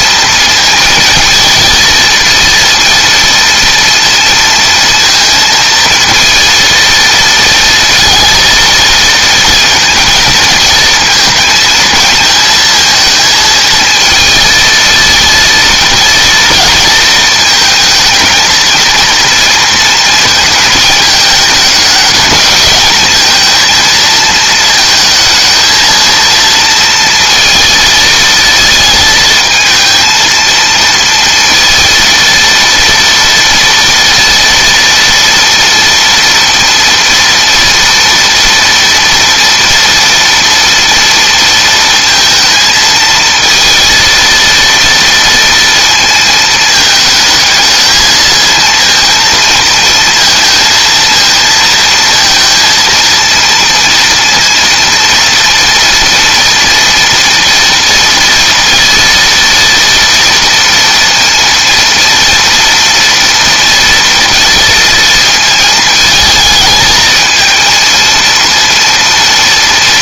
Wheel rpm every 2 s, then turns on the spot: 230, 230, 230, 230, 230, 220, 220, 230, 230, 230, 220, 220, 230, 230, 230, 230, 230, 230, 230, 230, 230, 230, 230, 220, 220, 230, 230, 230, 230, 230, 230, 230, 230, 220, 230.
none